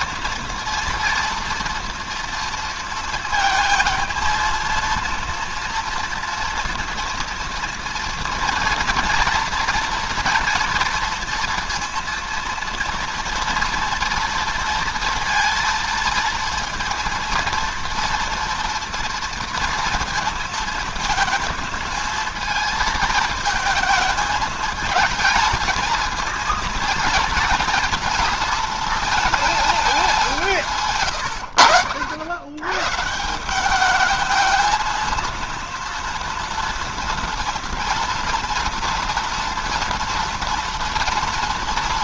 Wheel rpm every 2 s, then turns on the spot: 230, 230, 230, 230, 230, 230, 230, 230, 230, 240, 230, 220, 220, 230, 230, 170, 100, 220, 230, 230, 240.
none